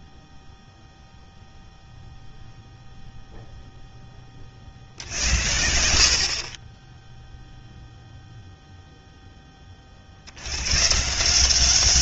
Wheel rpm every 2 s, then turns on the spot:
0, 40, 20, 0, 70, 200.
none